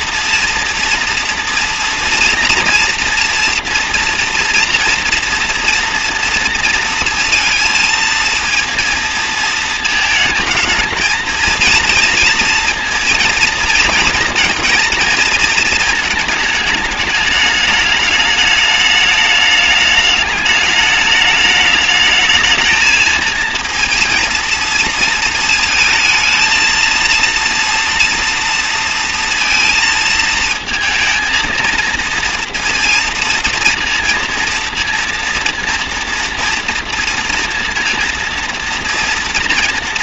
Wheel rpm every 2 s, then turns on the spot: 230, 230, 230, 230, 230, 220, 230, 230, 210, 210, 210, 220, 220, 230, 230, 220, 230, 230, 230, 230.
none